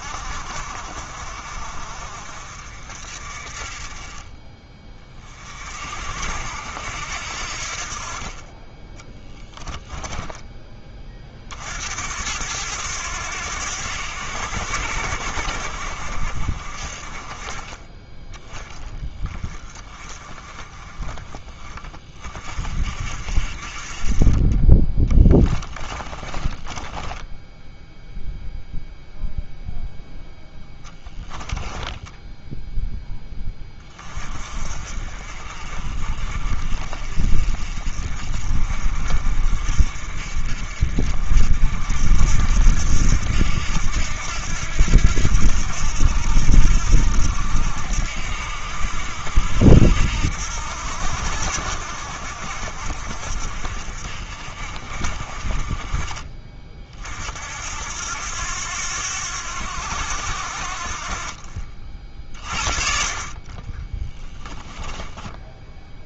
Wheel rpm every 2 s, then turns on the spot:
50, 50, 30, 70, 20, 20, 100, 80, 50, 20, 30, 50, 20, 20, 0, 10, 0, 40, 40, 50, 50, 70, 80, 80, 70, 80, 60, 50, 40, 90, 70, 40, 10.
8-10 26-28 64-66